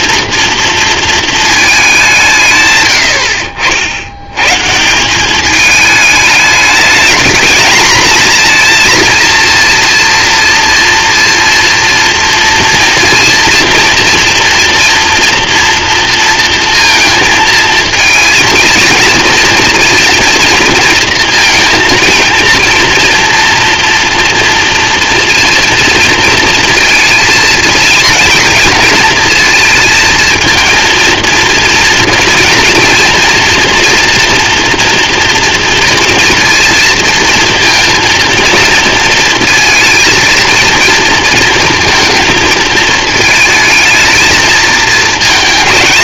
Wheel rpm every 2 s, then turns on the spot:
230, 130, 140, 220, 230, 230, 230, 230, 230, 230, 230, 240, 230, 230, 230, 230, 230, 230, 230, 220, 230, 220, 220.
none